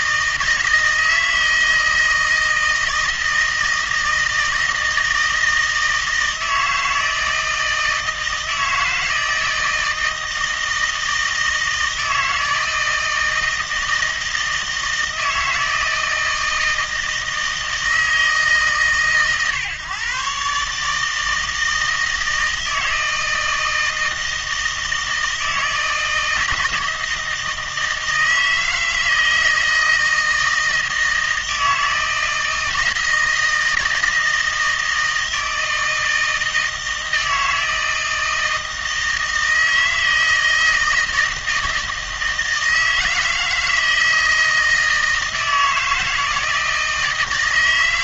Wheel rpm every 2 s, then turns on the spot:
160, 160, 170, 160, 160, 160, 160, 160, 160, 140, 150, 160, 160, 160, 160, 160, 160, 160, 160, 160, 160, 160, 160, 160.
none